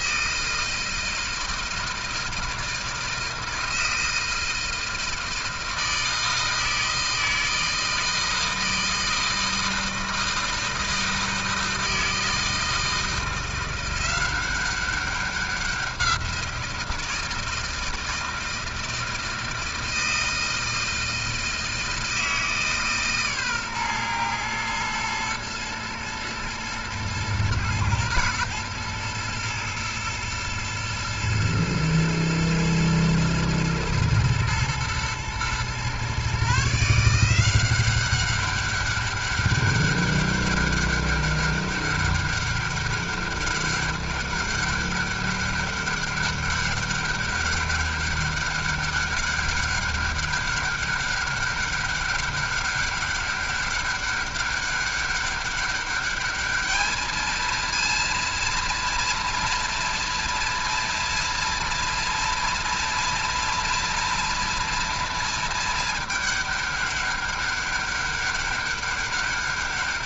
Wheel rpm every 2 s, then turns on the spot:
160, 160, 160, 160, 160, 160, 160, 190, 170, 160, 160, 150, 120, 110, 120, 110, 110, 120, 140, 200, 200, 200, 200, 200, 200, 200, 200, 200, 210, 230, 230, 230, 230, 210, 200.
none